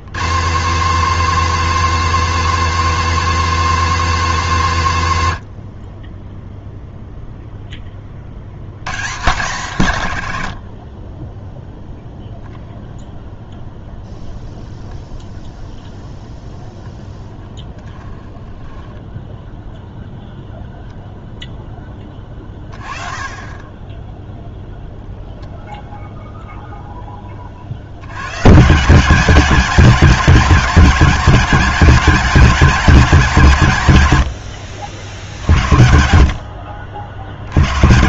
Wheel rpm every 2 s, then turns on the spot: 180, 260, 190, 0, 120, 50, 0, 0, 10, 10, 0, 30, 0, 0, 160, 200, 200, 60, 70.
18-20